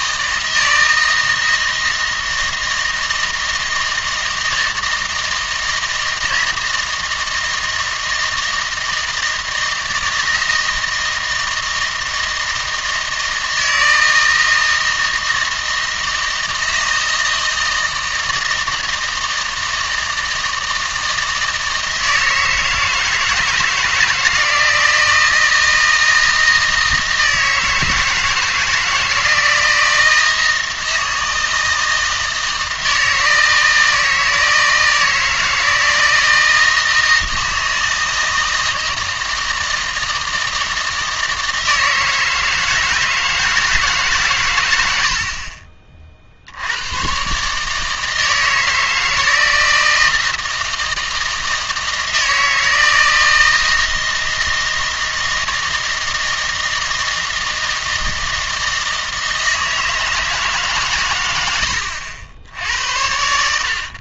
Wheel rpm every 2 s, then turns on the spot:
160, 160, 160, 160, 160, 160, 160, 160, 160, 160, 160, 160, 170, 160, 160, 160, 160, 160, 160, 160, 160, 160, 90, 100, 160, 160, 160, 160, 160, 160, 140, 80.
none